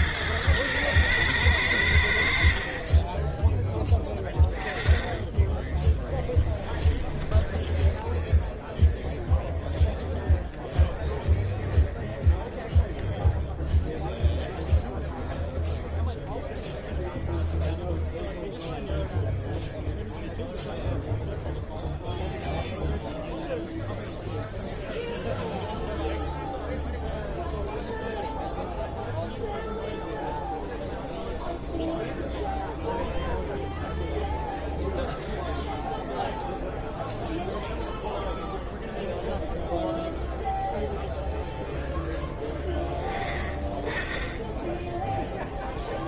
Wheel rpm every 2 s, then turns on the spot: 110, 50, 20, 10, 0, 10, 10, 0, 0, 0, 0, 0, 0, 0, 0, 0, 0, 0, 0, 0, 0, 10, 10.
6-8